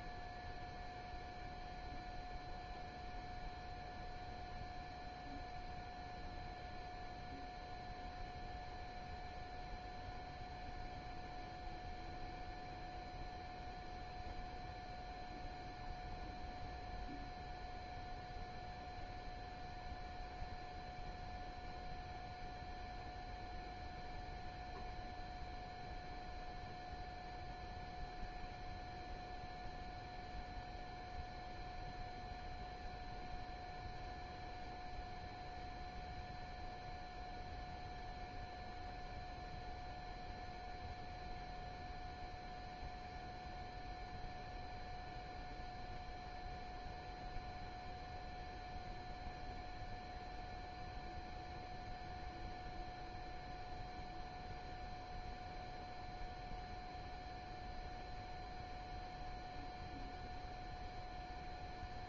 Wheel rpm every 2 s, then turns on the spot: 0, 0, 0, 0, 0, 0, 0, 0, 0, 0, 0, 0, 0, 0, 0, 0, 0, 0, 0, 0, 0, 0, 0, 0, 0, 0, 0, 0, 0, 0, 0.
none